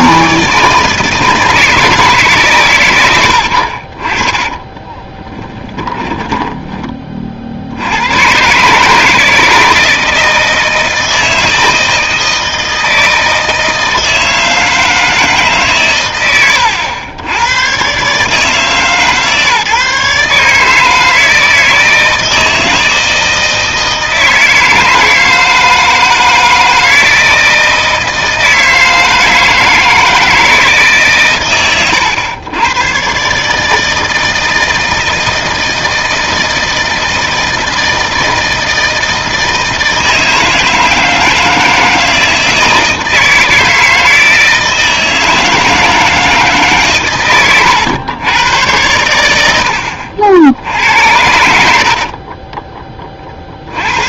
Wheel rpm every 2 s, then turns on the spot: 160, 110, 20, 20, 140, 160, 160, 160, 90, 150, 160, 160, 160, 160, 160, 160, 110, 160, 160, 160, 160, 160, 160, 150, 110, 70, 10.
4-6 50-52